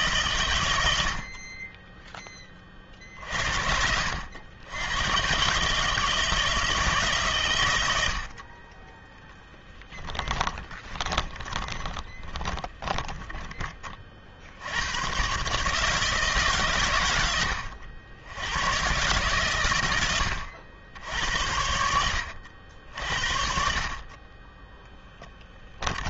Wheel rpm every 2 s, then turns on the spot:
100, 40, 90, 160, 30, 20, 20, 90, 130, 110, 80, 70, 10.
10-14